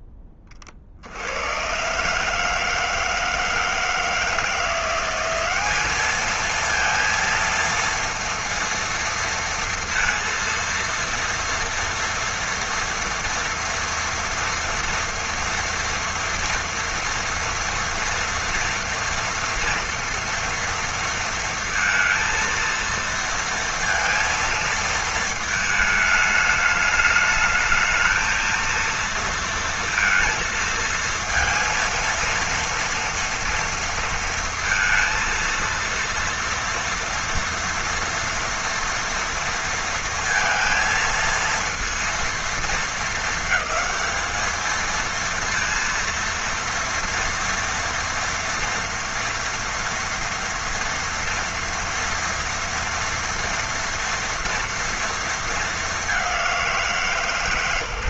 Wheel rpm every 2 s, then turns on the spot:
30, 160, 170, 230, 230, 230, 230, 230, 230, 240, 230, 230, 220, 210, 230, 230, 230, 230, 230, 240, 230, 230, 220, 230, 230, 230, 230, 230, 180.
none